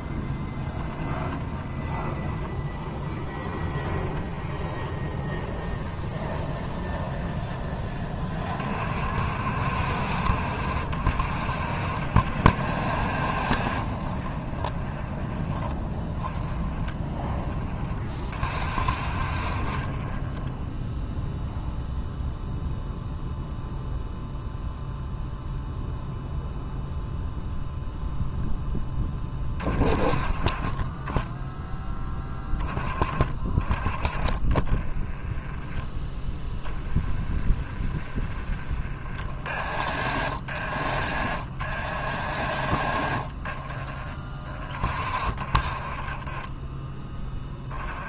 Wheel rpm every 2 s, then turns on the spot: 10, 10, 20, 10, 60, 60, 40, 20, 30, 40, 0, 0, 0, 0, 20, 10, 30, 10, 20, 30, 40, 30, 40, 20.
0-6 12-16